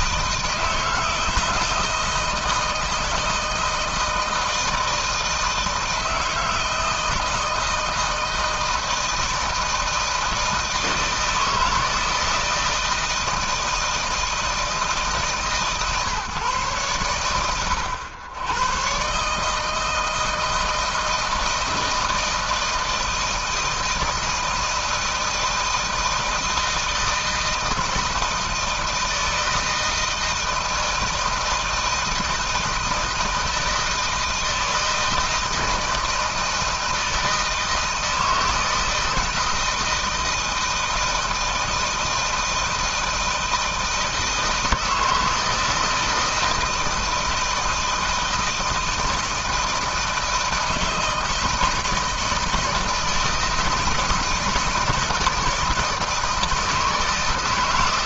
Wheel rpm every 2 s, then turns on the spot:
160, 160, 160, 160, 160, 160, 160, 150, 110, 130, 160, 160, 160, 160, 160, 160, 160, 160, 160, 160, 160, 160, 160, 160, 160, 170, 160, 160, 160.
none